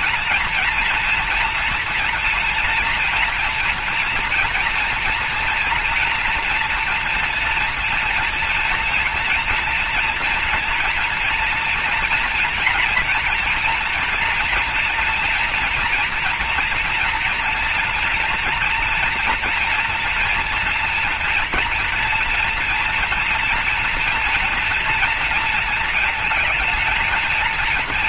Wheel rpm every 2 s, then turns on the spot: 240, 240, 230, 240, 230, 230, 230, 230, 230, 230, 230, 230, 230, 220.
none